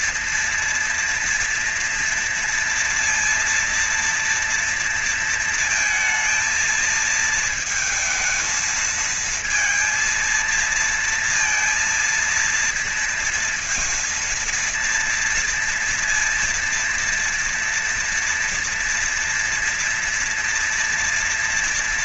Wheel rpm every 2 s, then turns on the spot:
230, 230, 230, 230, 220, 230, 230, 230, 230, 230, 230.
none